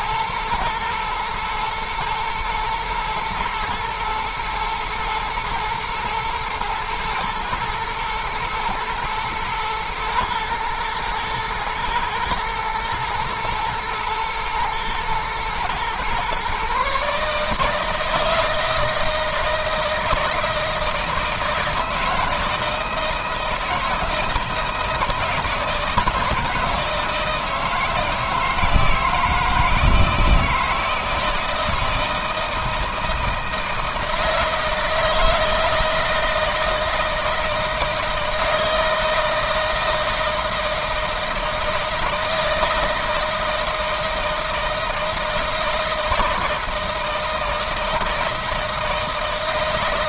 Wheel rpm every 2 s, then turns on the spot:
110, 110, 120, 120, 120, 120, 120, 120, 140, 160, 160, 160, 160, 160, 160, 160, 160, 160, 160, 160, 160, 160, 160, 160, 160.
none